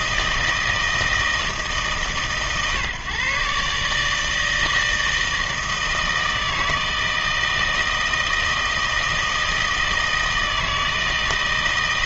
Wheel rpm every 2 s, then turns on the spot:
160, 140, 160, 160, 160, 160.
none